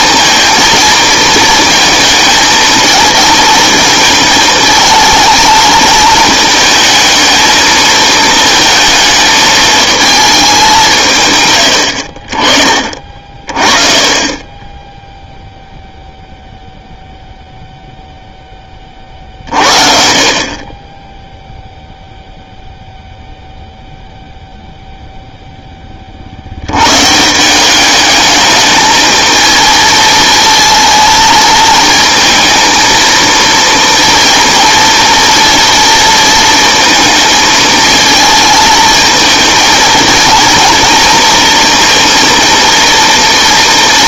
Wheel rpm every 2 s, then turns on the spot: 230, 220, 220, 220, 220, 210, 50, 20, 0, 40, 20, 0, 10, 180, 220, 220, 230, 230, 220, 220, 230, 230.
none